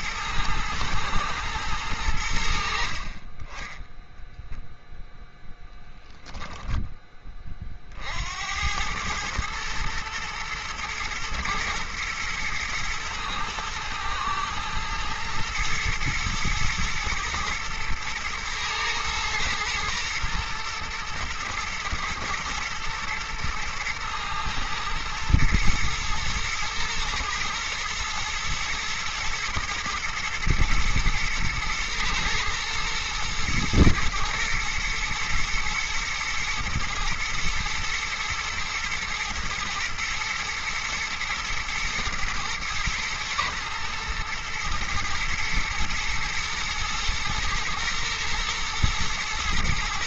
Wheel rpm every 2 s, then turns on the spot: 120, 60, 0, 10, 100, 110, 110, 110, 110, 110, 120, 120, 120, 110, 110, 120, 110, 120, 120, 110, 110, 110, 110, 110, 120.
none